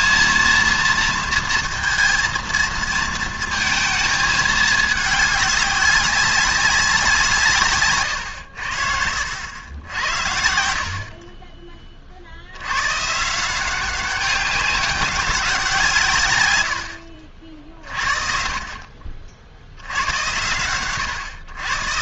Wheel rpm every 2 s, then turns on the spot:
230, 230, 210, 190, 100, 70, 100, 200, 110, 40, 110.
none